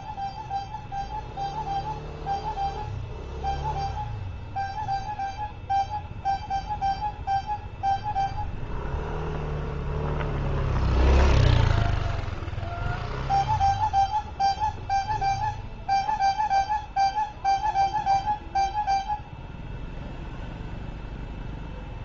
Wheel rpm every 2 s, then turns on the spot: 0, 0, 0, 0, 0, 0, 0, 0, 0, 0, 0.
none